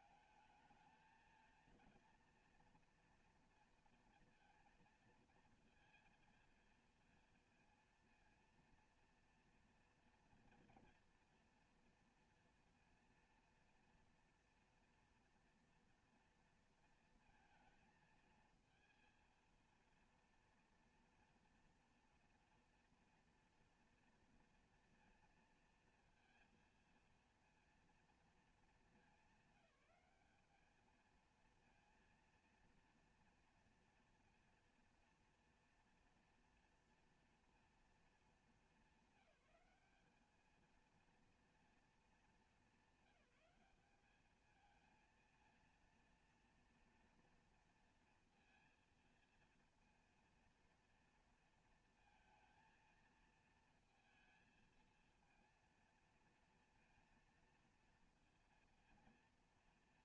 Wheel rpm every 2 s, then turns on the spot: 210, 230, 230, 230, 230, 230, 230, 230, 230, 230, 230, 230, 230, 230, 220, 210, 230, 240, 230, 220, 220, 220, 220, 230, 230, 230, 230, 230, 230, 230.
none